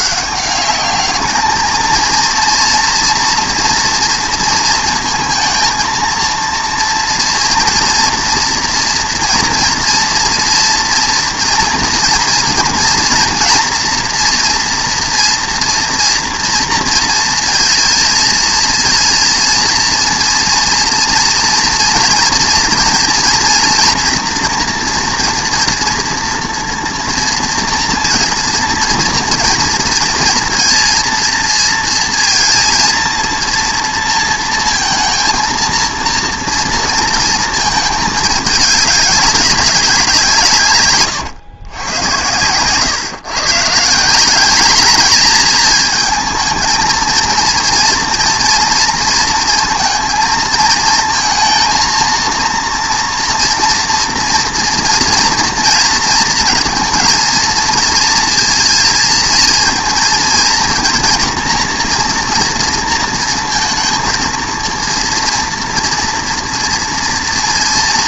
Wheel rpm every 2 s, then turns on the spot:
200, 230, 230, 230, 230, 230, 230, 230, 230, 230, 230, 230, 230, 230, 230, 230, 230, 230, 230, 210, 140, 120, 210, 220, 230, 230, 230, 230, 230, 230, 230, 230, 230, 230.
none